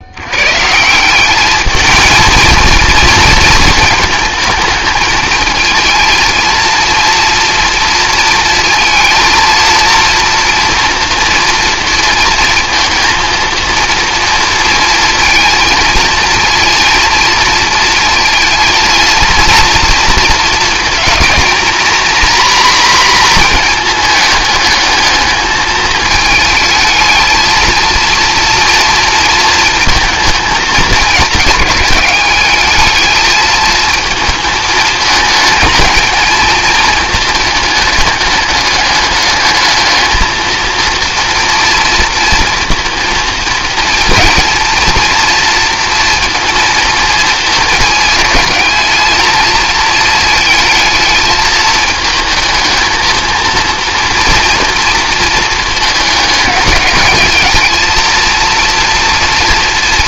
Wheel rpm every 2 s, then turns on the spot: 100, 220, 220, 230, 230, 230, 230, 230, 230, 230, 220, 250, 220, 220, 230, 220, 200, 220, 220, 210, 220, 230, 230, 230, 220, 220, 220, 230, 210, 230.
none